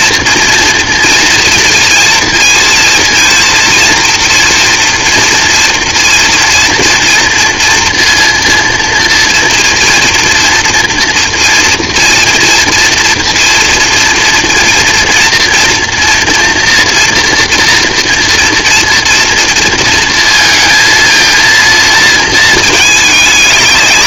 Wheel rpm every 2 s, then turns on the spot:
230, 230, 230, 230, 230, 230, 240, 240, 230, 230, 230, 220.
none